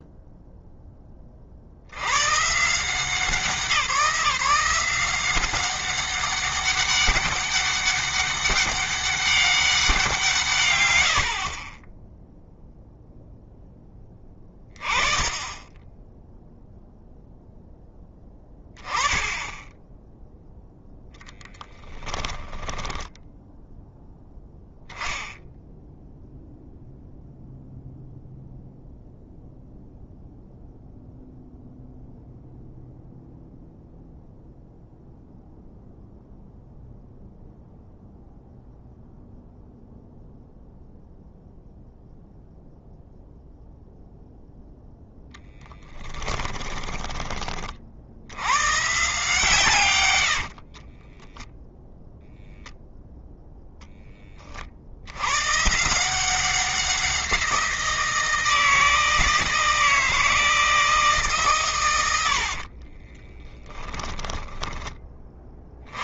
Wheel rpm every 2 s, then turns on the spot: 10, 160, 180, 200, 200, 80, 0, 20, 0, 20, 0, 10, 0, 0, 0, 0, 0, 0, 0, 0, 0, 0, 0, 20, 140, 20, 0, 70, 180, 160, 160, 40, 30.
22-24 46-48 50-52 62-64